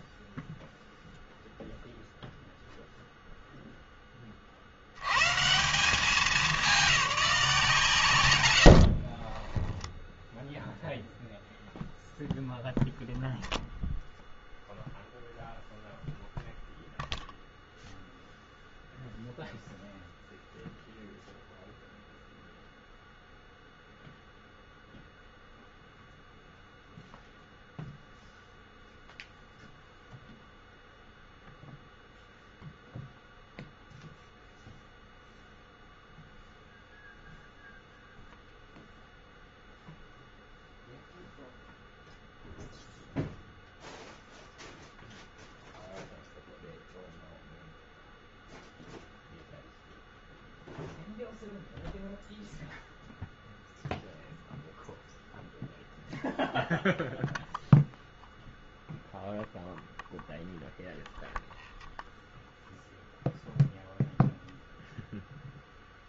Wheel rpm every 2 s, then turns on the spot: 0, 0, 70, 200, 70, 0, 0, 0, 0, 0, 0, 0, 0, 0, 0, 0, 0, 0, 0, 0, 0, 0, 0, 0, 0, 0, 0, 0, 0, 0, 0, 0, 0.
8-10